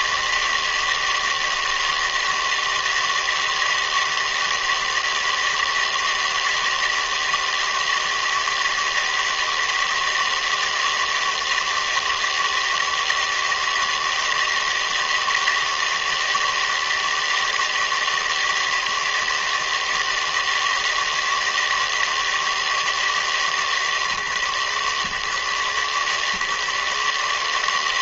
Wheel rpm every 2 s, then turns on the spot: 160, 160, 160, 160, 160, 160, 160, 160, 160, 160, 160, 160, 130, 150.
none